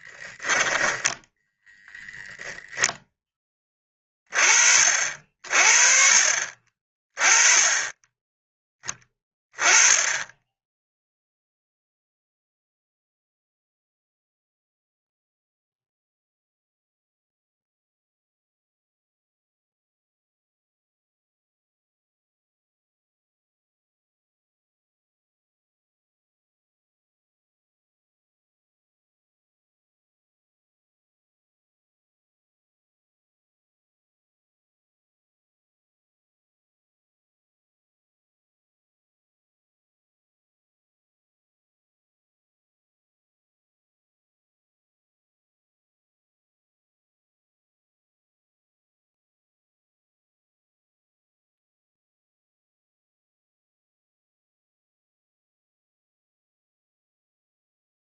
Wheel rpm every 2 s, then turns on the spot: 10, 0, 30, 40, 10, 10, 0, 0, 0, 0, 0, 0, 0, 0, 0, 0, 0, 0, 0, 0, 0, 0, 0, 0, 0, 0, 0, 0, 0.
none